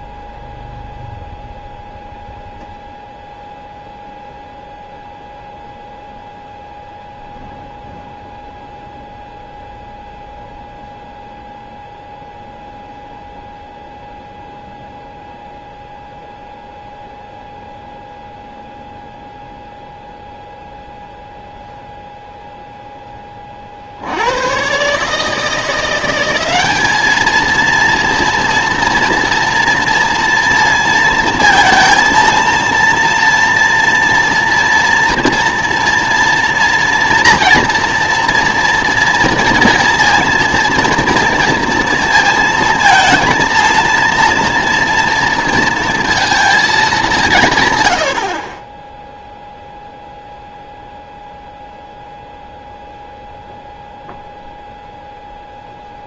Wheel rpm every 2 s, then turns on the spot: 0, 0, 0, 0, 0, 0, 0, 0, 0, 0, 0, 10, 120, 200, 230, 230, 230, 230, 230, 230, 230, 230, 230, 210, 20, 0, 0, 0.
none